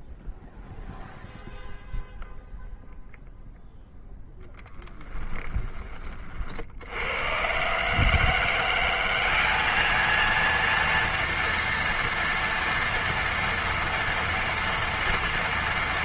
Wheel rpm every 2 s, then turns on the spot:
0, 0, 10, 60, 180, 230, 240, 230.
none